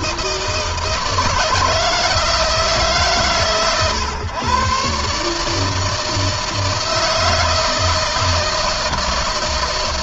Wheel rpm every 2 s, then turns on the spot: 150, 140, 140, 160, 160.
none